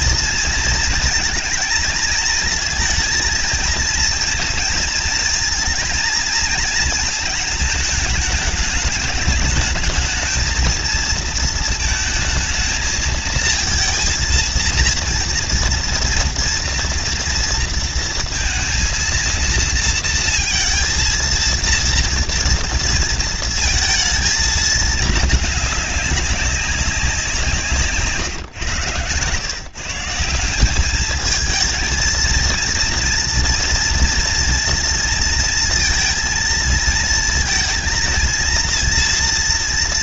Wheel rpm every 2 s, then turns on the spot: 230, 220, 230, 230, 210, 220, 220, 230, 230, 230, 230, 230, 230, 200, 140, 170, 230, 230, 230, 230.
28-30